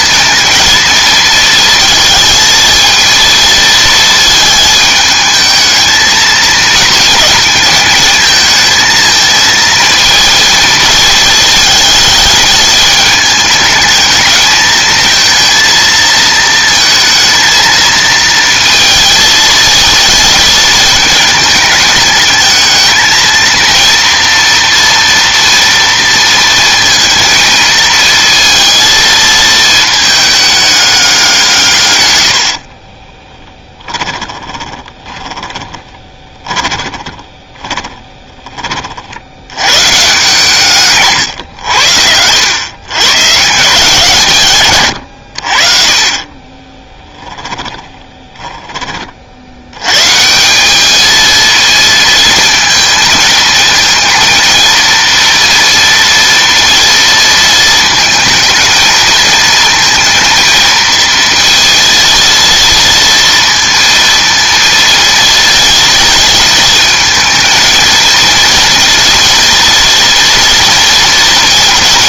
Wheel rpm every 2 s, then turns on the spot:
230, 230, 220, 220, 220, 220, 210, 220, 220, 230, 220, 220, 230, 230, 230, 200, 50, 20, 30, 40, 150, 110, 120, 20, 20, 190, 230, 230, 230, 220, 230, 230, 230, 220, 230, 230.
32-38 46-48